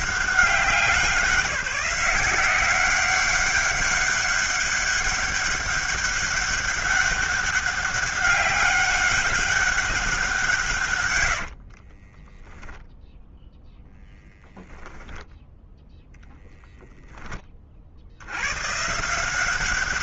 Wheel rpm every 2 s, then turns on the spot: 190, 190, 200, 200, 200, 150, 0, 0, 10, 130.
none